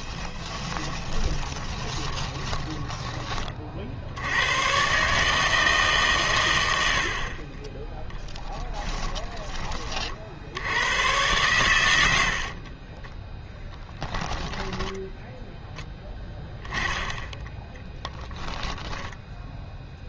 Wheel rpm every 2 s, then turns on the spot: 20, 10, 110, 90, 10, 80, 40, 10, 10, 10.
0-4 8-10 12-20